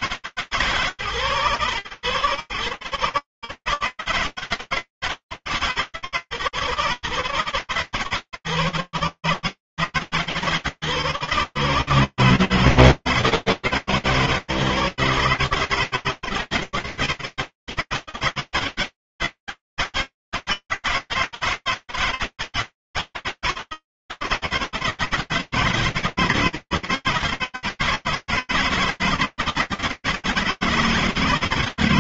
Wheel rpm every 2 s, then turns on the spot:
150, 130, 160, 130, 140, 150, 160, 150, 160, 160, 160, 160, 160, 160, 160, 160.
none